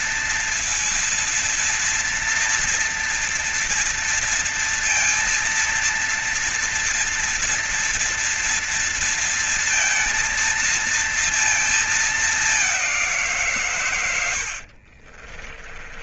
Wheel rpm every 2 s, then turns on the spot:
230, 230, 230, 230, 230, 230, 190, 60.
14-16